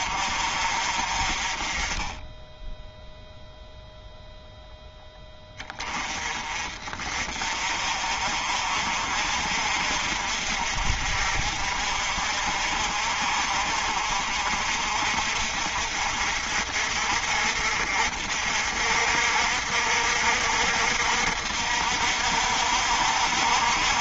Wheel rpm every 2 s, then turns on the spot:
40, 0, 0, 40, 50, 50, 50, 50, 50, 60, 60, 60.
none